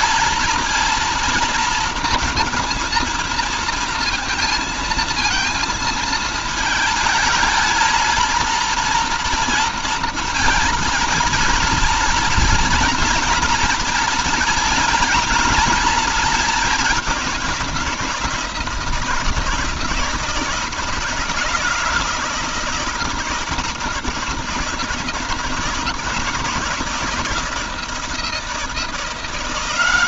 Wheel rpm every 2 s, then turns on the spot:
230, 230, 230, 220, 230, 230, 230, 230, 210, 170, 160, 160, 160, 160, 170.
none